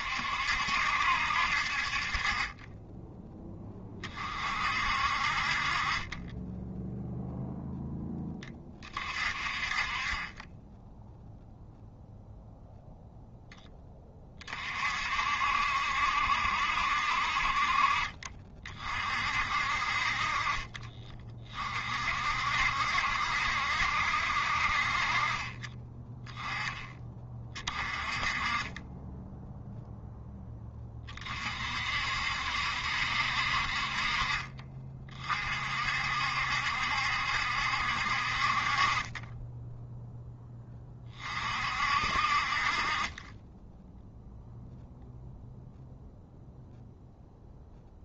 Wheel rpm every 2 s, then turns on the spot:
70, 20, 40, 10, 30, 10, 0, 50, 60, 40, 30, 60, 50, 10, 20, 20, 70, 30, 70, 40, 20, 40, 0, 0.
20-22